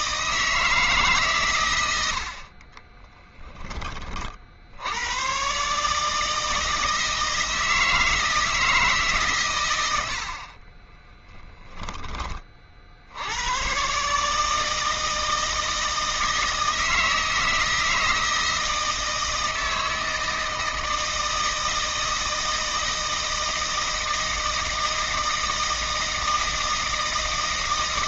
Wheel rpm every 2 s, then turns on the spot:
160, 50, 60, 160, 160, 50, 30, 150, 160, 160, 160, 160, 160, 160.
2-4